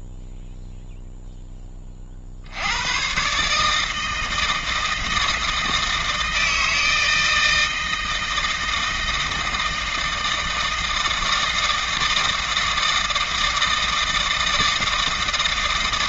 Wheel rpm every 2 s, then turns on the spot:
0, 110, 160, 160, 160, 160, 160, 160.
none